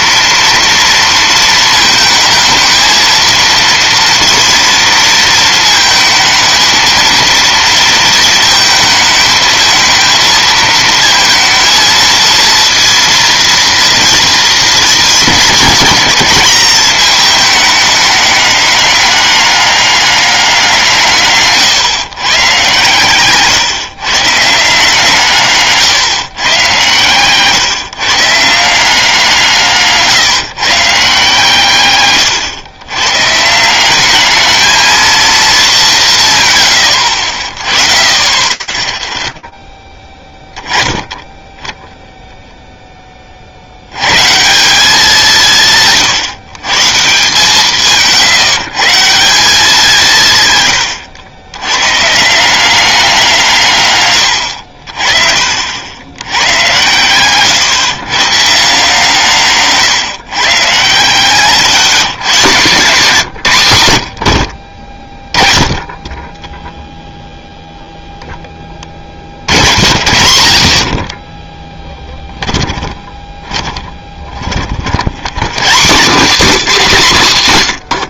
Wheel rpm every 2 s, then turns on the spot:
230, 220, 230, 220, 220, 220, 230, 230, 220, 200, 180, 130, 160, 120, 160, 140, 100, 220, 120, 0, 10, 0, 170, 140, 150, 120, 180, 80, 110, 150, 140, 160, 50, 0, 50, 20, 20, 90, 190.
50-52 70-74